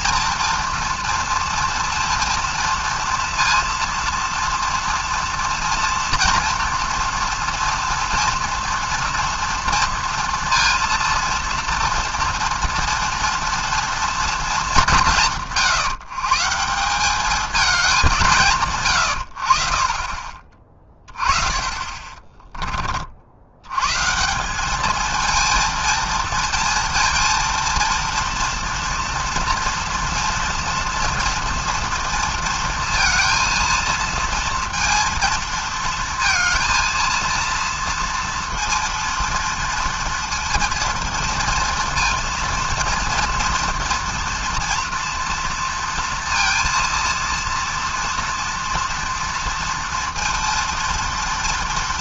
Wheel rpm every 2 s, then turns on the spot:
230, 230, 230, 230, 230, 230, 240, 190, 180, 140, 30, 30, 200, 230, 230, 230, 230, 230, 230, 230, 230, 230, 230, 230, 230, 230.
none